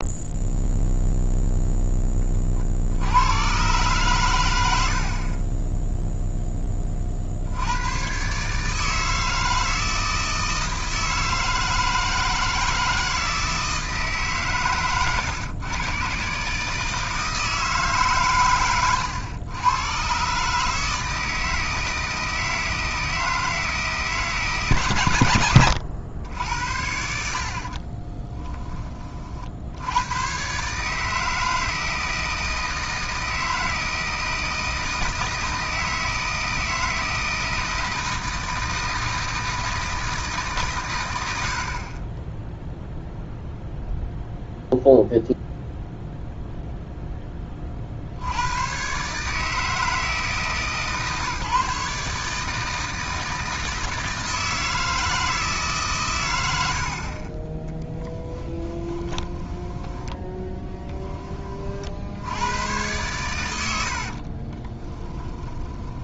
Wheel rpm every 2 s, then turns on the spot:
0, 60, 70, 30, 160, 160, 160, 120, 150, 110, 160, 160, 140, 70, 20, 150, 160, 160, 160, 160, 120, 0, 0, 0, 130, 150, 160, 160, 60, 10, 20, 110, 20.
58-62 64-66